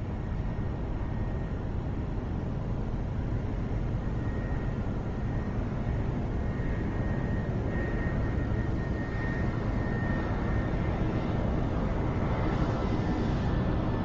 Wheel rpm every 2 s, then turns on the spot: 0, 0, 0, 0, 0, 0, 0.
none